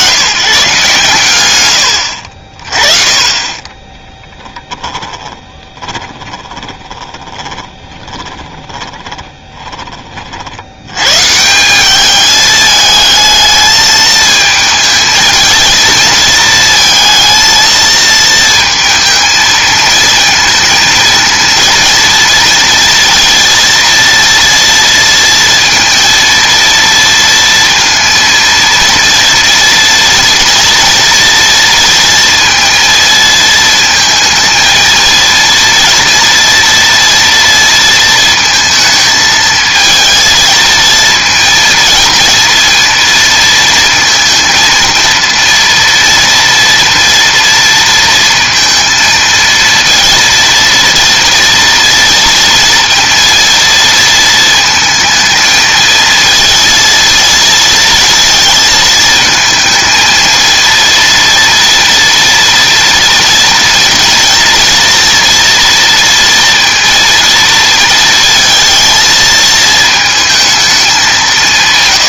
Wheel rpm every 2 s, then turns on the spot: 140, 40, 20, 30, 20, 80, 220, 220, 220, 230, 230, 230, 230, 230, 230, 230, 230, 220, 240, 220, 230, 230, 230, 230, 230, 230, 230, 220, 230, 230, 230, 230, 240, 230, 220, 210.
4-10